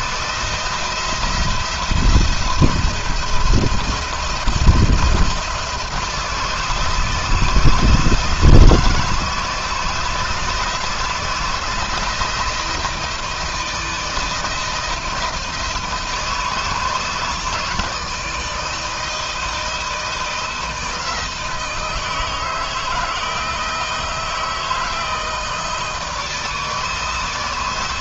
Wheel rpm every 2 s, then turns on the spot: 170, 170, 170, 160, 160, 160, 160, 160, 160, 160, 160, 160, 160, 160.
none